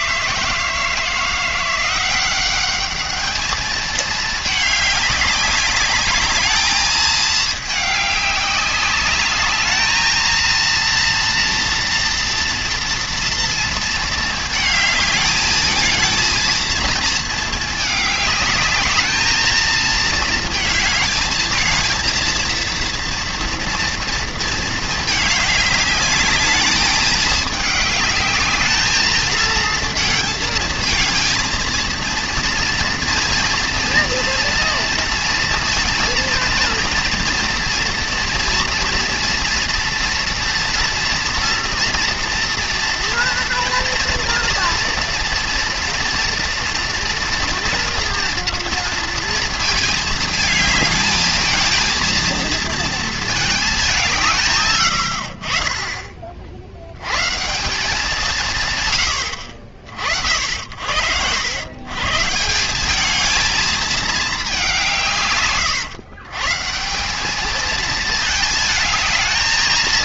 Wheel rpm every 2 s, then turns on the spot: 160, 200, 210, 220, 200, 230, 240, 220, 230, 210, 220, 230, 220, 210, 220, 220, 230, 230, 230, 230, 230, 230, 230, 230, 230, 220, 230, 100, 80, 140, 60, 190, 180, 170, 220.
none